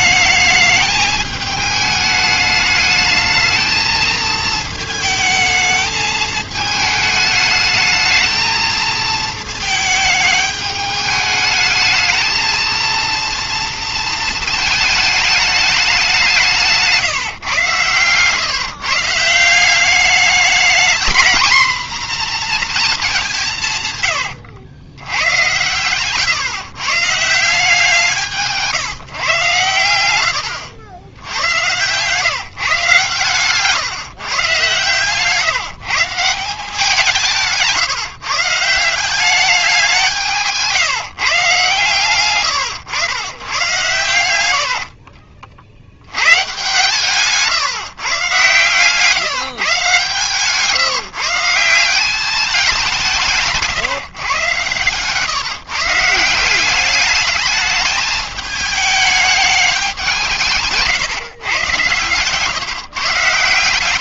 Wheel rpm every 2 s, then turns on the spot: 220, 210, 220, 220, 220, 210, 230, 220, 160, 140, 210, 230, 80, 150, 160, 90, 150, 130, 170, 170, 160, 120, 70, 130, 130, 140, 200, 120, 190, 210, 140, 140.
44-46 60-62